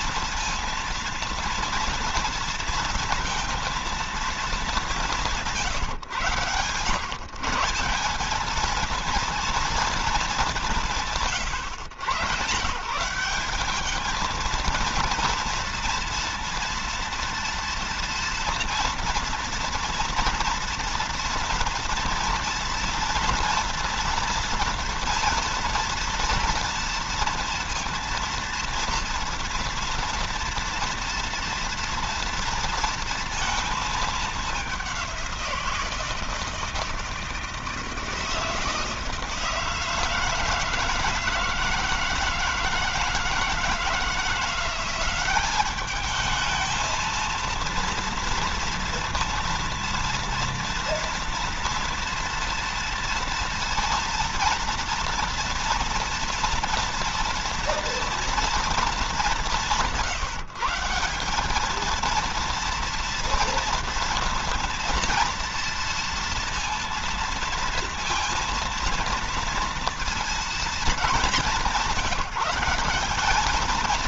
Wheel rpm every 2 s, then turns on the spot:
230, 230, 190, 140, 220, 150, 150, 230, 230, 230, 230, 230, 230, 230, 230, 240, 230, 190, 160, 160, 160, 160, 190, 230, 230, 230, 230, 230, 230, 210, 180, 240, 230, 230, 230, 210, 200.
none